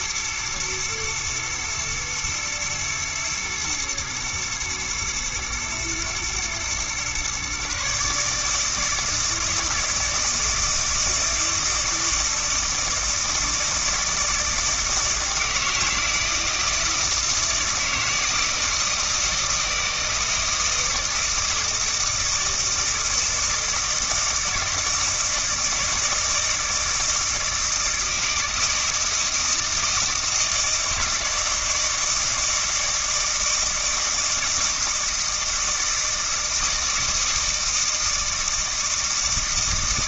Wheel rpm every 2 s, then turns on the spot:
120, 110, 110, 120, 150, 160, 160, 160, 160, 160, 160, 160, 160, 160, 160, 160, 160, 160, 160, 160.
none